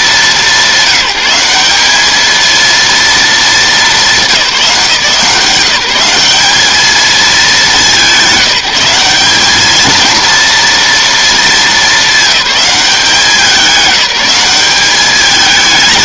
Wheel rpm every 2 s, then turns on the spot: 170, 230, 170, 210, 190, 230, 200, 200.
none